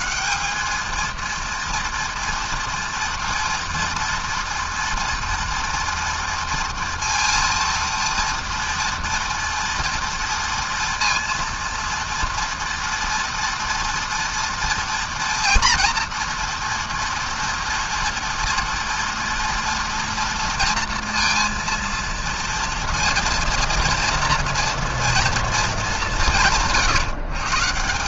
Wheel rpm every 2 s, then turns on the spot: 210, 230, 230, 230, 230, 230, 230, 230, 240, 230, 230, 230, 230, 140.
none